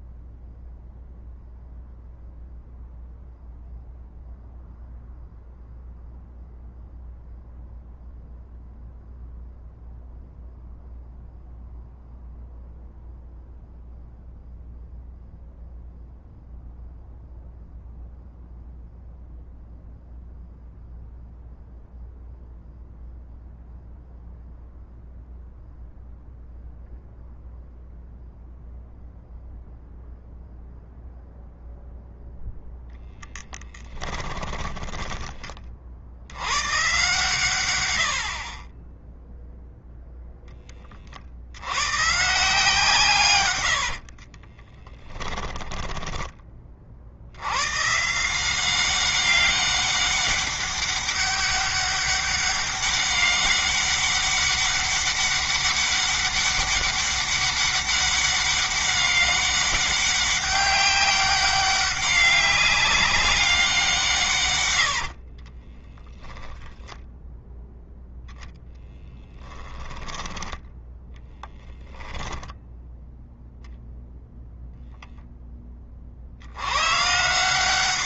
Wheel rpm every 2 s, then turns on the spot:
0, 0, 0, 0, 0, 0, 0, 0, 0, 0, 0, 0, 0, 0, 0, 0, 0, 10, 120, 20, 30, 140, 20, 40, 190, 200, 200, 200, 200, 200, 190, 200, 90, 0, 10, 10, 0, 10, 120.
34-36 44-46 64-66